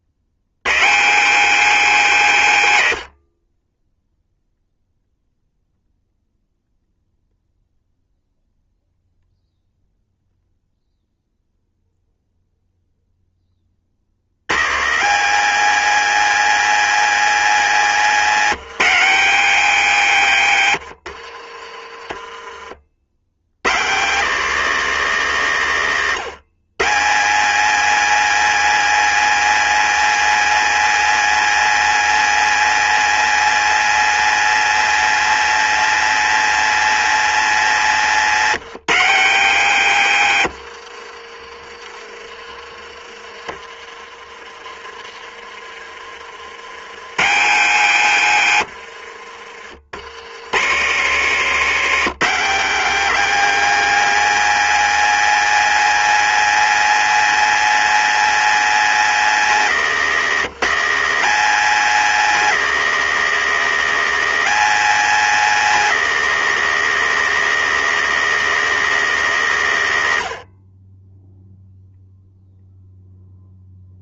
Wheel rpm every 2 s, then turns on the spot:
150, 120, 0, 0, 0, 0, 0, 140, 210, 200, 100, 60, 210, 150, 230, 230, 230, 230, 230, 190, 80, 30, 30, 110, 80, 150, 230, 230, 230, 230, 200, 230, 230, 230, 220, 50, 0.
40-42 48-50